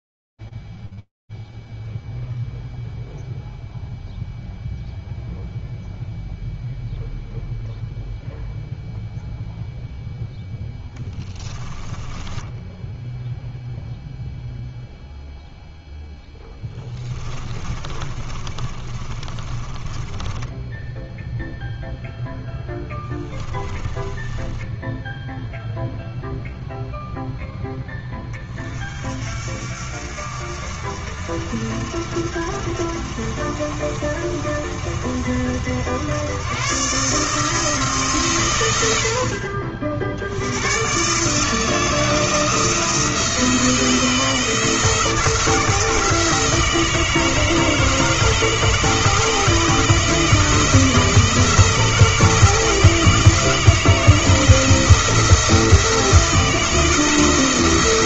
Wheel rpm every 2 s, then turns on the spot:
0, 0, 0, 0, 0, 0, 10, 0, 10, 30, 10, 10, 10, 0, 50, 60, 60, 70, 160, 50, 150, 170, 160, 160, 160, 170, 160, 170, 160.
12-14 16-26